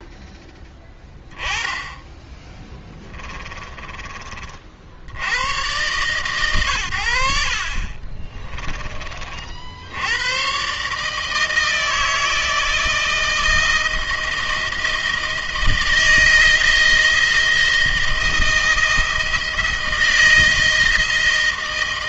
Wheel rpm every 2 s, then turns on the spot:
10, 10, 40, 110, 20, 130, 160, 160, 160, 160, 170.
2-4